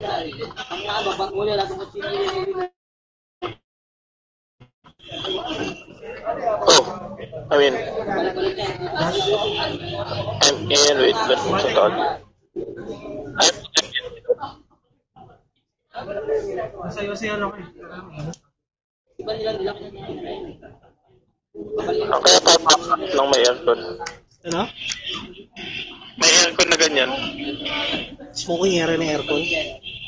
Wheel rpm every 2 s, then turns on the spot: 0, 0, 0, 0, 0, 0, 0, 0, 0, 0, 0, 0, 0, 0, 0.
none